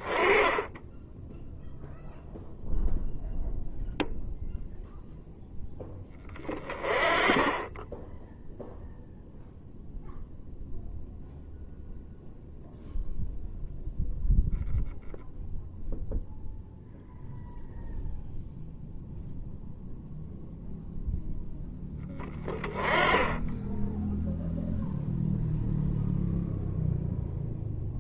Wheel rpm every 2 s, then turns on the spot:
0, 0, 0, 20, 0, 0, 0, 0, 0, 0, 0, 20, 0, 0.
none